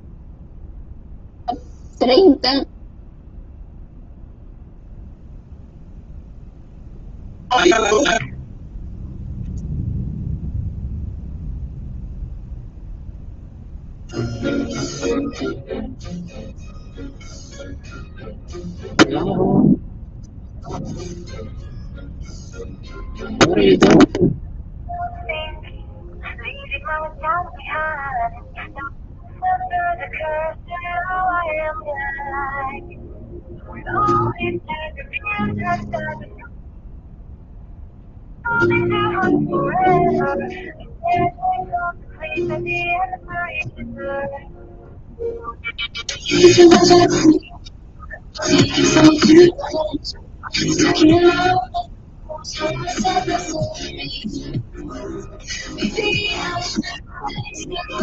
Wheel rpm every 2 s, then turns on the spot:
0, 0, 0, 0, 0, 0, 0, 0, 0, 0, 0, 0, 0, 0, 0, 0, 0, 0, 0, 0, 0, 0, 0, 0, 0, 0, 0, 0, 0.
none